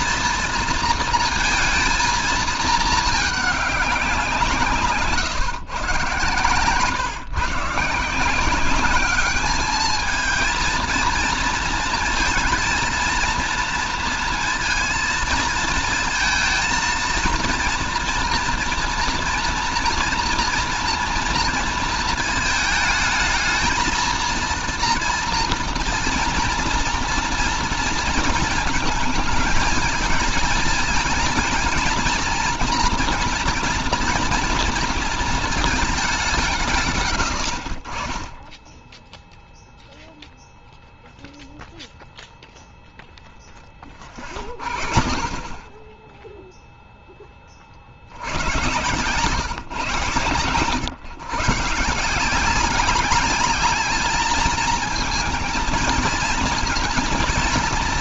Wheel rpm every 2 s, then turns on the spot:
230, 220, 150, 130, 190, 220, 230, 230, 230, 230, 230, 220, 230, 240, 220, 220, 230, 230, 130, 10, 0, 0, 30, 0, 120, 120, 190, 220, 220.
none